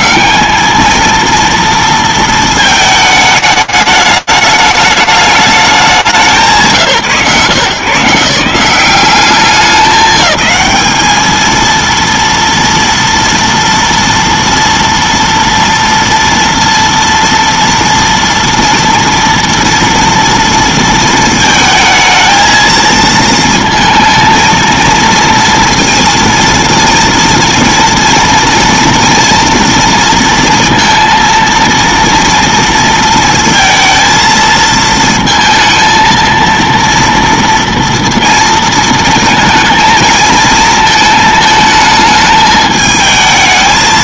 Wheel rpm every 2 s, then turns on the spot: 110, 230, 210, 180, 150, 190, 230, 230, 230, 230, 230, 220, 230, 230, 230, 230, 230, 220, 230, 230, 220, 220.
none